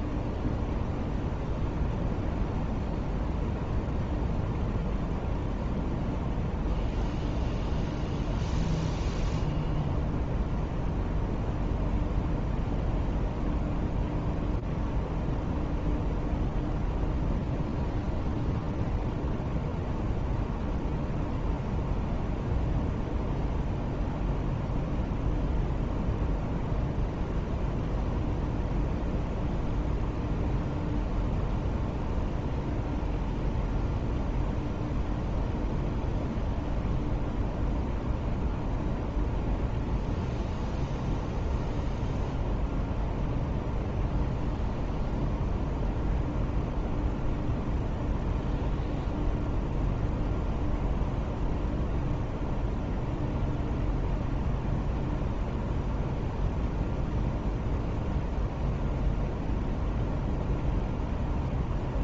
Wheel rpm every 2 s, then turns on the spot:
0, 0, 0, 0, 0, 0, 0, 0, 0, 0, 0, 0, 0, 0, 0, 0, 0, 0, 0, 0, 0, 0, 0, 0, 0, 0, 0, 0, 0, 0, 0.
none